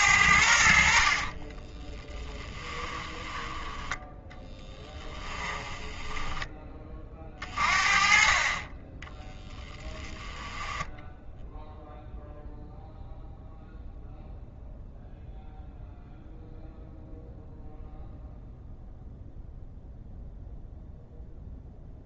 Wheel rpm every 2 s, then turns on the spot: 70, 10, 10, 10, 40, 20, 0, 0, 0, 0, 0.
2-4 6-8 10-12